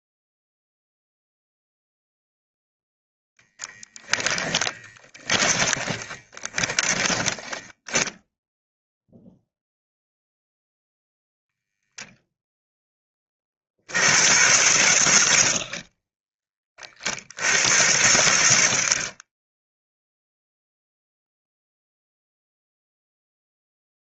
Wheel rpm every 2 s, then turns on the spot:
0, 0, 20, 10, 0, 0, 10, 110, 50, 20, 0, 0.
4-8